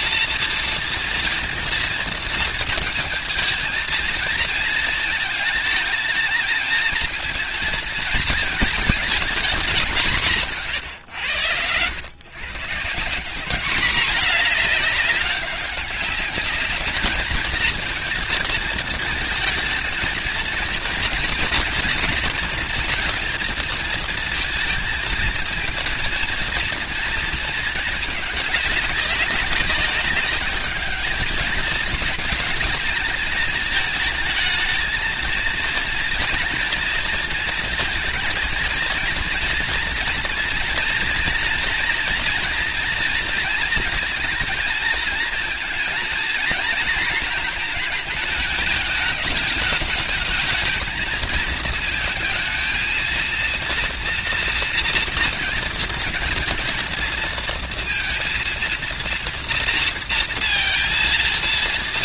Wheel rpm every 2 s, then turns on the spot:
230, 230, 230, 220, 220, 170, 130, 220, 210, 230, 230, 240, 230, 230, 210, 200, 220, 220, 230, 220, 240, 230, 230, 230, 220, 220, 220, 230, 230, 230, 230.
none